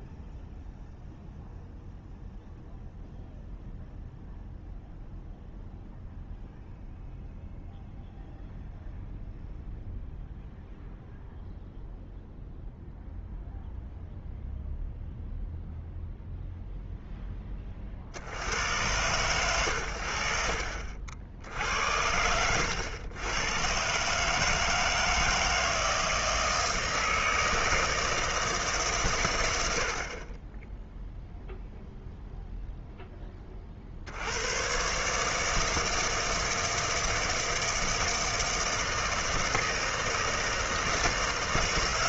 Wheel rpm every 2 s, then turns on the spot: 0, 0, 0, 0, 0, 0, 0, 0, 0, 80, 50, 90, 160, 160, 150, 20, 0, 100, 160, 160, 160.
none